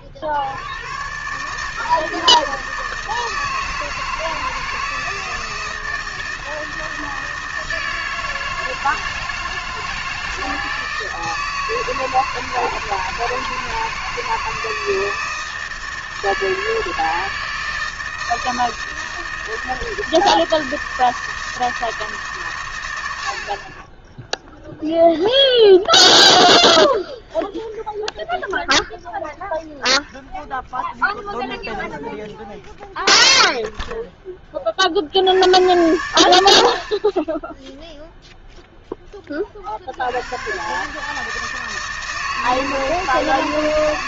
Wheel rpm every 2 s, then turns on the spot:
50, 160, 160, 160, 160, 160, 160, 160, 160, 160, 160, 120, 0, 0, 0, 0, 0, 20, 70, 0, 120, 160.
none